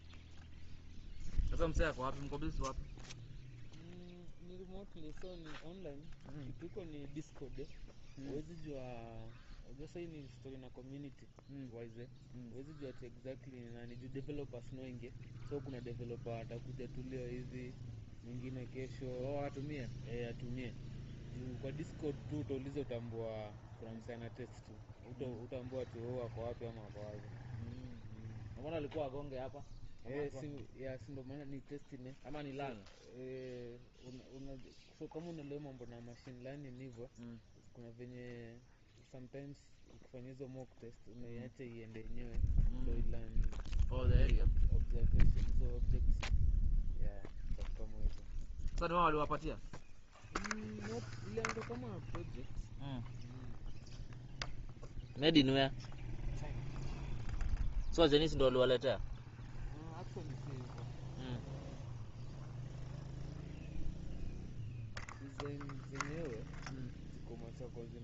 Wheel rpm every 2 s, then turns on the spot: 0, 0, 0, 0, 0, 0, 0, 0, 0, 0, 0, 0, 0, 0, 0, 0, 0, 0, 0, 0, 0, 0, 0, 0, 0, 0, 0, 0, 0, 0, 0, 0, 0, 0.
none